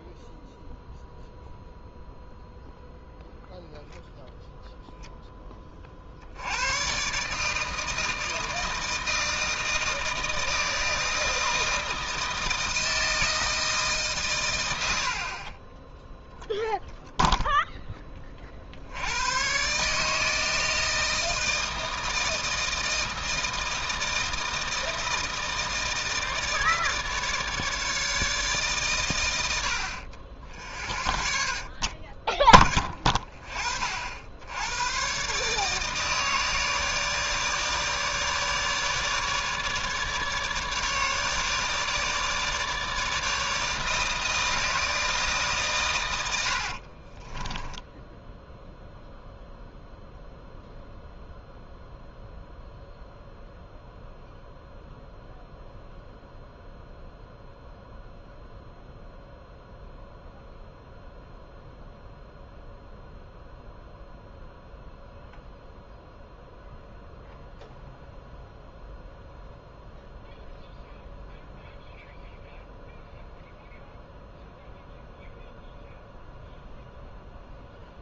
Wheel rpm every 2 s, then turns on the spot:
0, 0, 10, 120, 160, 160, 160, 100, 0, 60, 160, 160, 160, 160, 130, 0, 10, 90, 160, 150, 150, 160, 160, 60, 0, 0, 0, 0, 0, 0, 0, 0, 0, 0, 0, 0, 0, 0, 0.
46-48